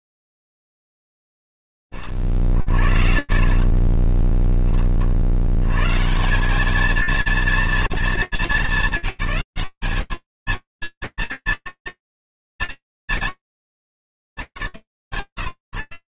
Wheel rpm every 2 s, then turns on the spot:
60, 60, 20, 160, 220, 220, 240, 190.
4-6